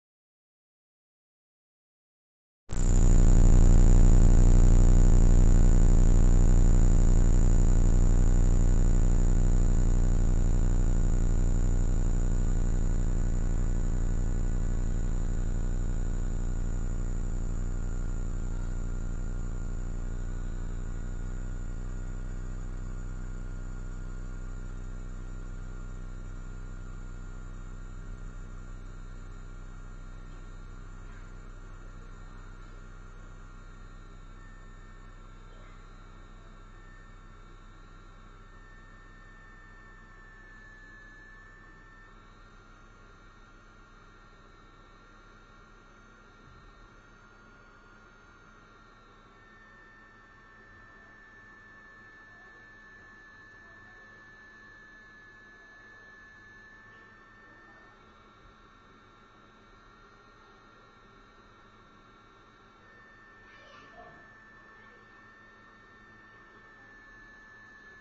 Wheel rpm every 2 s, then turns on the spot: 0, 0, 0, 0, 0, 0, 0, 0, 0, 0, 0, 0, 0, 0, 0, 0, 0, 0, 0, 0, 0, 0, 0, 0, 0, 0, 0, 0, 0, 0, 0, 0, 0, 0.
none